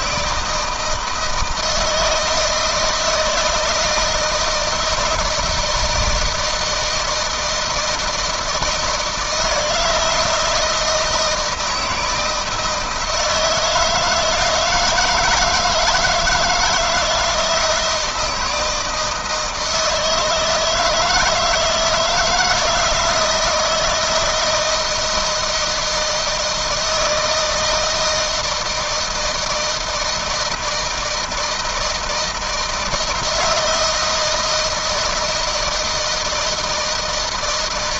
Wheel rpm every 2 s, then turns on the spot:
160, 160, 160, 160, 160, 160, 160, 160, 160, 160, 160, 170, 160, 160, 160, 160, 160, 160, 160.
none